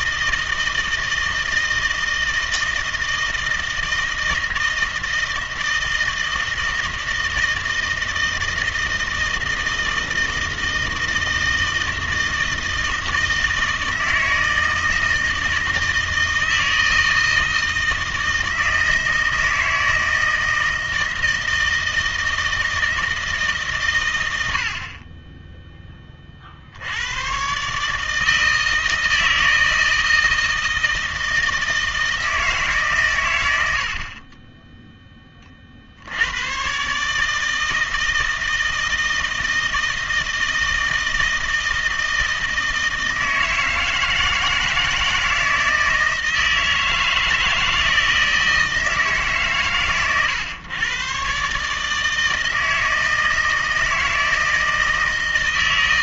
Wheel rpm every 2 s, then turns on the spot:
160, 160, 160, 160, 160, 160, 160, 160, 160, 160, 160, 160, 50, 70, 160, 160, 150, 10, 130, 160, 160, 160, 160, 160, 160, 120, 160, 160.
none